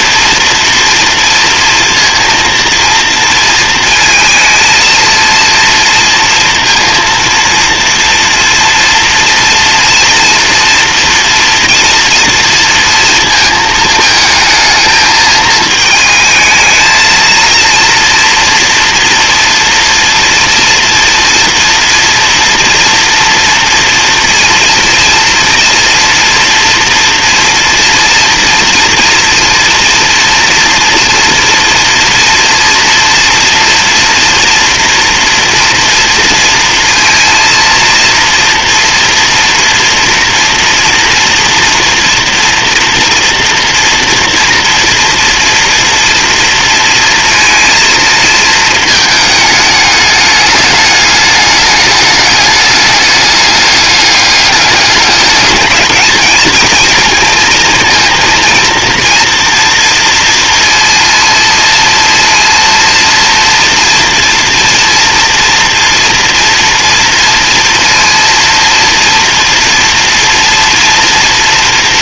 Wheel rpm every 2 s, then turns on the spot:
230, 230, 230, 230, 230, 240, 230, 220, 220, 230, 230, 230, 230, 230, 240, 230, 230, 230, 230, 230, 240, 230, 230, 230, 220, 210, 210, 200, 230, 240, 230, 230, 240, 230, 230, 230.
none